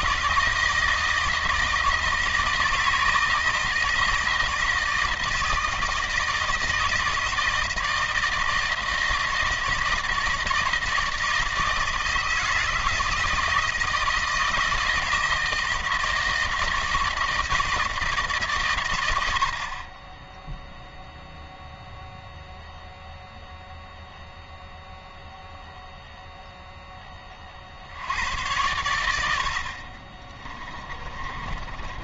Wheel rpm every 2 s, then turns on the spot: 160, 160, 160, 160, 160, 160, 160, 160, 160, 120, 0, 0, 0, 10, 90, 30.
30-32